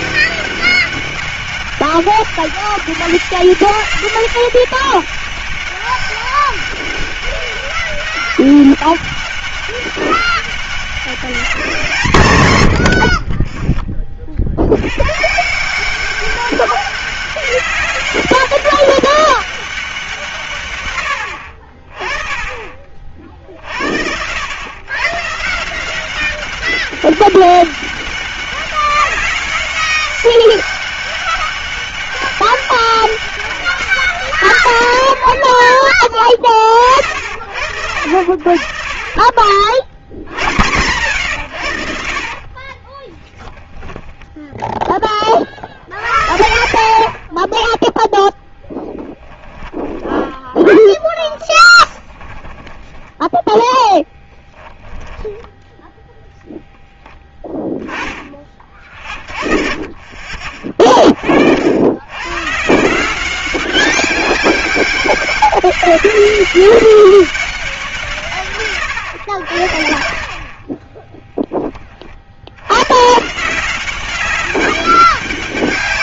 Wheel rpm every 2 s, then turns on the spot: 200, 200, 200, 200, 200, 200, 110, 80, 200, 200, 140, 30, 100, 190, 200, 200, 200, 120, 30, 60, 100, 30, 10, 70, 10, 10, 20, 10, 10, 30, 40, 150, 190, 200, 130, 30, 80, 200.
42-44 48-56 70-72